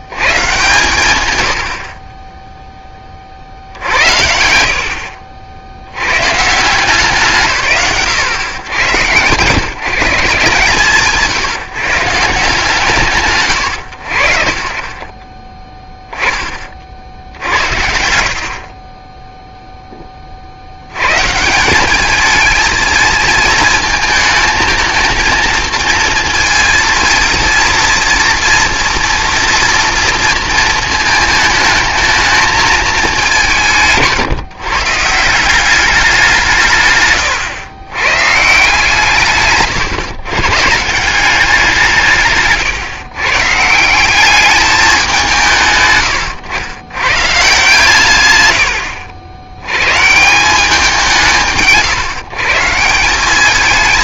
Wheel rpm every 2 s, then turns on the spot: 120, 40, 70, 140, 120, 130, 120, 10, 50, 30, 100, 220, 220, 230, 240, 230, 210, 160, 140, 150, 180, 130, 180, 120, 60, 160, 180.
18-20